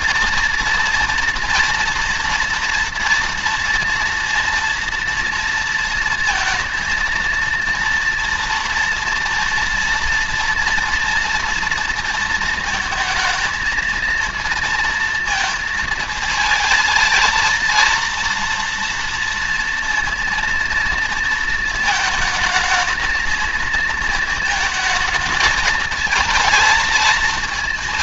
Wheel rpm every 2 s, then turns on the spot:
230, 230, 230, 230, 230, 230, 230, 230, 230, 230, 230, 220, 220, 220.
none